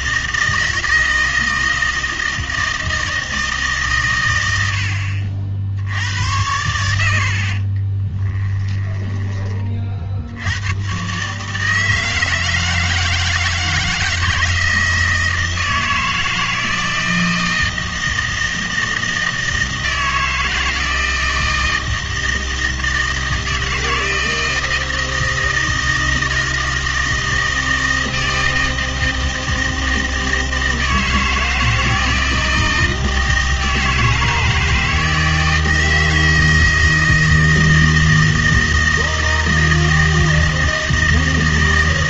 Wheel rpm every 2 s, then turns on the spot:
160, 160, 90, 90, 10, 110, 160, 160, 160, 160, 160, 160, 160, 160, 160, 160, 160, 160, 160, 160, 160.
none